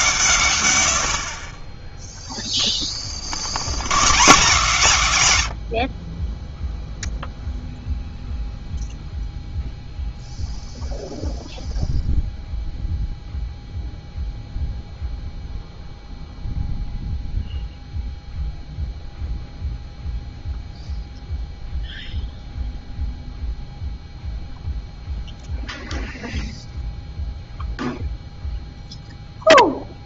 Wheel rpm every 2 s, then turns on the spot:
100, 10, 160, 0, 0, 0, 0, 0, 0, 0, 0, 0, 0, 0, 0.
2-4